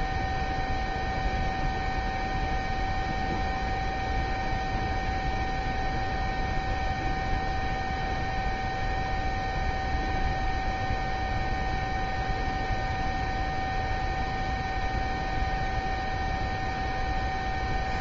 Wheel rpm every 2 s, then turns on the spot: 0, 0, 0, 0, 0, 0, 0, 0, 0.
none